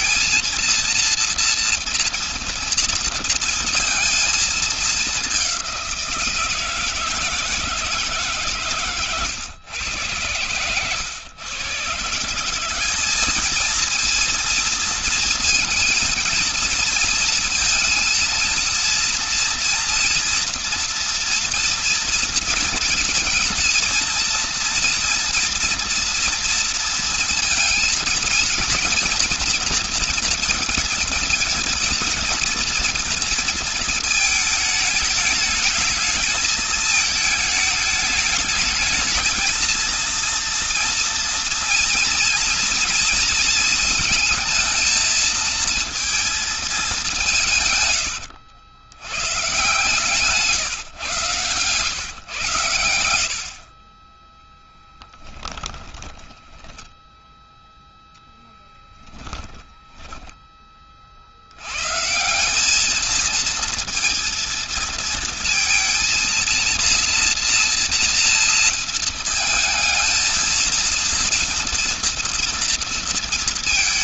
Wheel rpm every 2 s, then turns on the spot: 230, 240, 220, 170, 150, 110, 170, 230, 230, 230, 240, 230, 230, 230, 230, 230, 230, 220, 220, 210, 230, 230, 230, 230, 100, 140, 110, 10, 20, 0, 10, 180, 230, 230, 230, 230, 230.
54-58